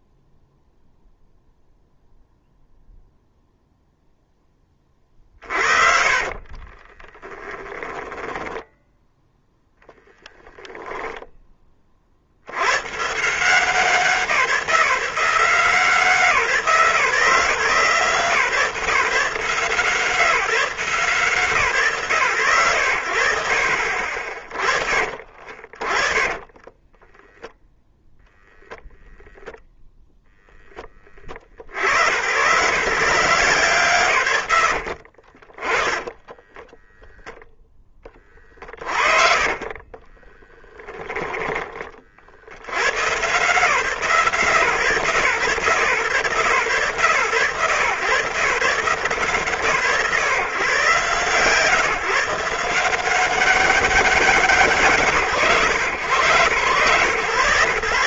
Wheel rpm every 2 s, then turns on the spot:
0, 0, 10, 30, 10, 0, 70, 170, 160, 140, 160, 130, 50, 30, 0, 0, 110, 90, 10, 40, 30, 80, 140, 130, 130, 130, 150, 180, 110.
6-10 24-26 34-38 40-42